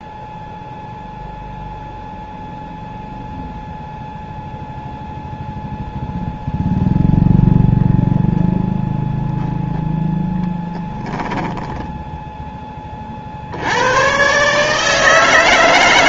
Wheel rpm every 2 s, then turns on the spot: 0, 0, 0, 0, 0, 10, 20, 150.
10-12